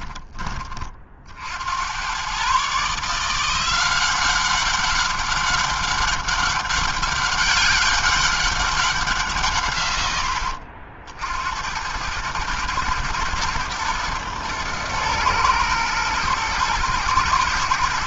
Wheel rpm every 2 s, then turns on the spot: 50, 160, 200, 200, 190, 70, 110, 110, 90.
none